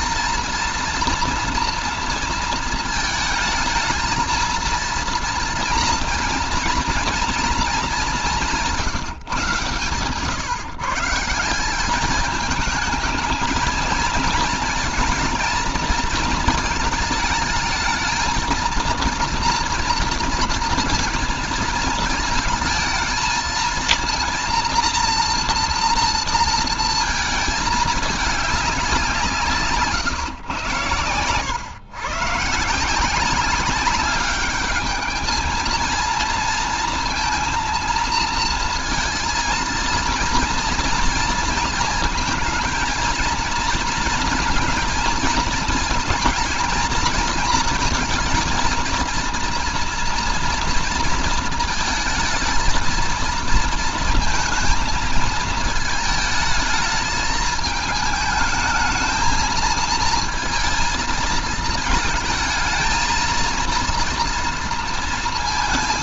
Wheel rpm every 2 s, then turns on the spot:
230, 220, 230, 220, 180, 130, 210, 230, 220, 220, 230, 230, 230, 230, 190, 120, 150, 210, 230, 230, 230, 230, 220, 230, 230, 230, 230, 230, 220, 220, 230, 220, 230.
none